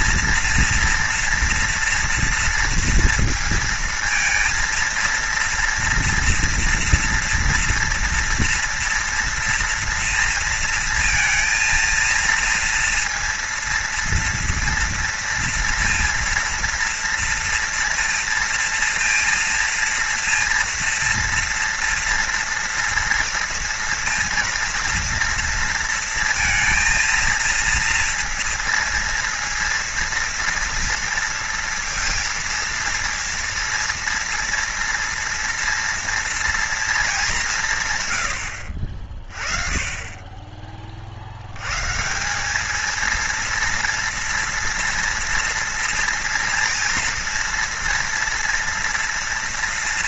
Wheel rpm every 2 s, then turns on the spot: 230, 230, 230, 230, 230, 230, 230, 230, 230, 230, 230, 230, 230, 230, 230, 230, 230, 230, 230, 70, 20, 200, 230, 230, 240.
none